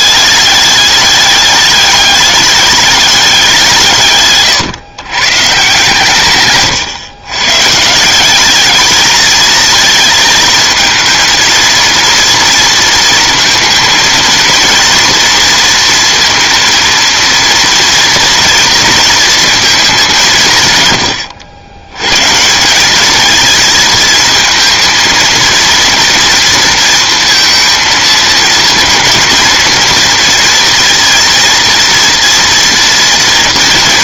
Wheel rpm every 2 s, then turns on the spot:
210, 210, 140, 130, 210, 220, 230, 230, 230, 230, 140, 180, 220, 230, 230, 230, 230.
6-8